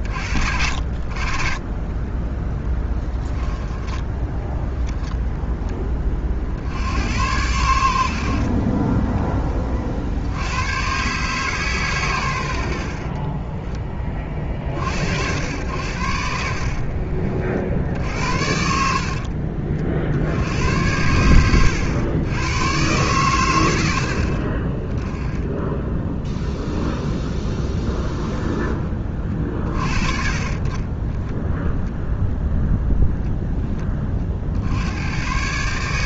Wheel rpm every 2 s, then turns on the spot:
60, 10, 0, 80, 20, 110, 70, 50, 50, 60, 80, 110, 30, 0, 20, 20, 0, 80.
2-4 16-20